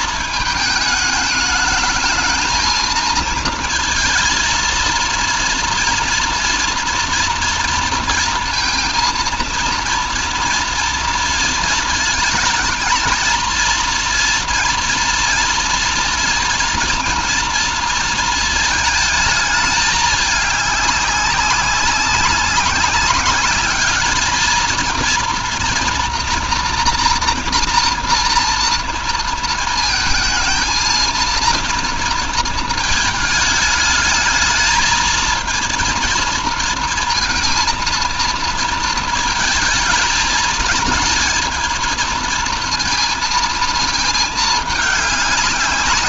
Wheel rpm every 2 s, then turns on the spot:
220, 220, 230, 240, 230, 230, 220, 230, 230, 220, 200, 190, 230, 240, 230, 230, 220, 220, 230, 230, 220, 230, 210.
none